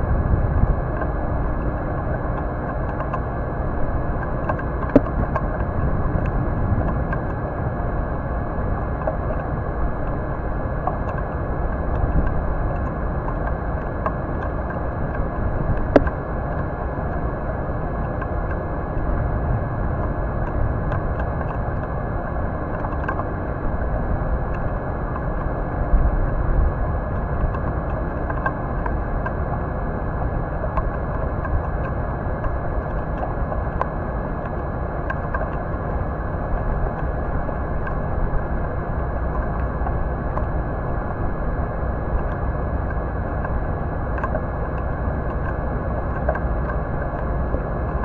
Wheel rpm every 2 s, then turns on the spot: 0, 0, 0, 0, 0, 0, 0, 0, 0, 0, 0, 0, 0, 0, 0, 0, 0, 0, 0, 0, 0, 0, 0, 0.
none